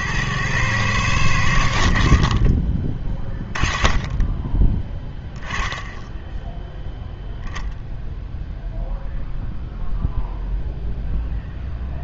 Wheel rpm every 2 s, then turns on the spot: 110, 30, 10, 10, 0, 0.
none